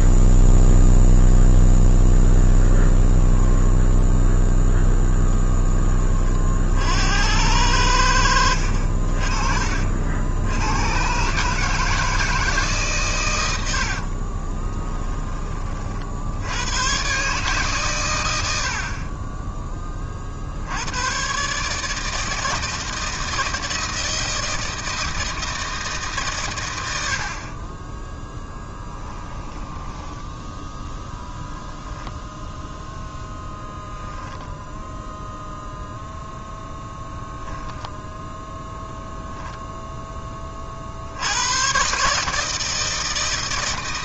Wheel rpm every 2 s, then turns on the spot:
0, 0, 10, 50, 70, 100, 150, 20, 100, 70, 80, 160, 160, 110, 10, 10, 10, 0, 0, 0, 50, 160.
14-16 28-30